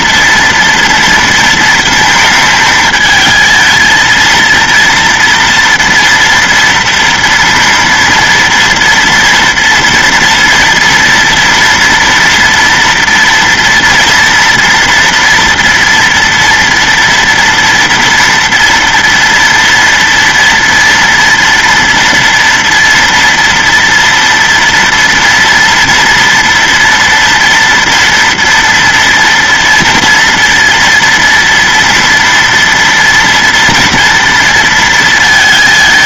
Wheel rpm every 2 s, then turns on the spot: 230, 220, 230, 230, 230, 230, 230, 230, 230, 230, 230, 230, 230, 230, 240, 230, 230, 230.
none